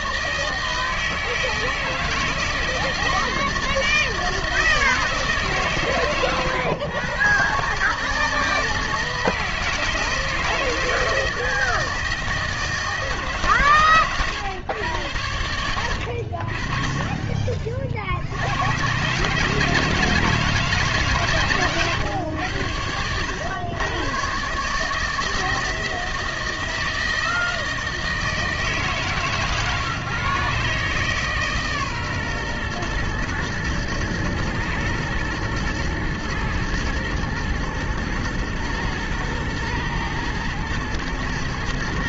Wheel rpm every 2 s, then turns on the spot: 160, 160, 160, 120, 160, 160, 160, 110, 30, 100, 160, 100, 140, 160, 150, 140, 120, 110, 110, 110, 110.
none